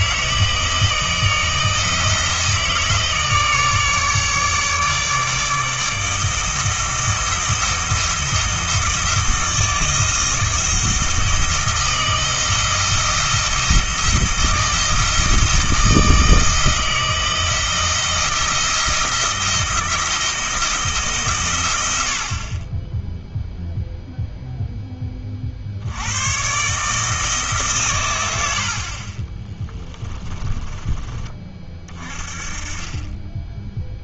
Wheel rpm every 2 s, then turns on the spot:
160, 160, 150, 160, 160, 160, 170, 160, 160, 170, 160, 20, 10, 140, 60, 20, 30.
30-32